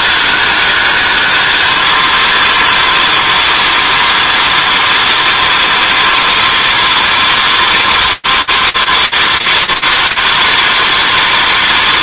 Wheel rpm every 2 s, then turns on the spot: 330, 330, 330, 320, 330, 330.
none